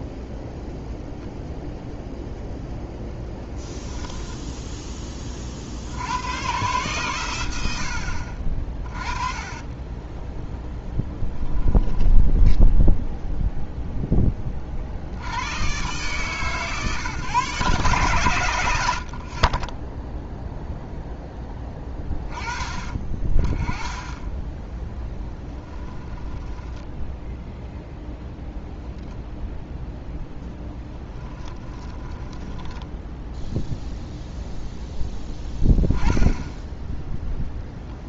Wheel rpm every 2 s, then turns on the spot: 0, 0, 10, 130, 30, 0, 10, 40, 140, 90, 0, 20, 10, 10, 0, 10, 10, 0, 0.
26-28 30-34